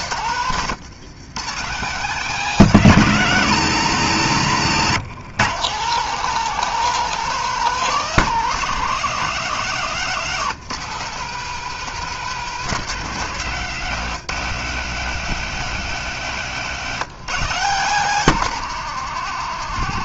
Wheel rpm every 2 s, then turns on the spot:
150, 170, 160, 170, 180, 170, 190, 150, 170, 170.
none